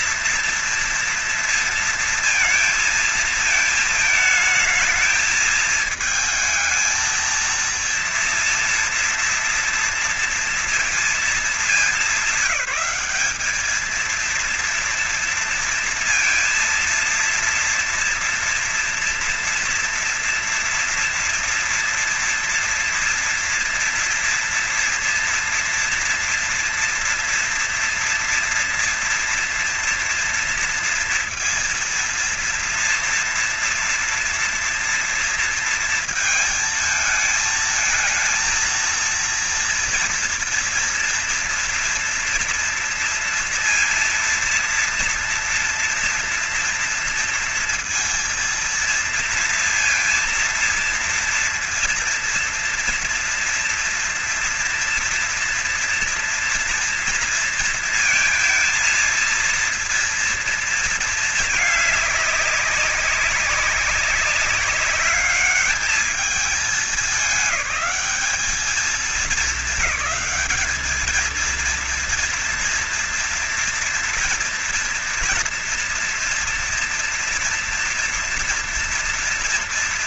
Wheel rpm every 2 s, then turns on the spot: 230, 230, 220, 220, 240, 220, 190, 230, 230, 230, 230, 230, 230, 230, 240, 230, 230, 230, 220, 230, 230, 230, 230, 230, 230, 230, 230, 230, 230, 230, 230, 200, 200, 210, 210, 210, 230, 230, 230, 230.
none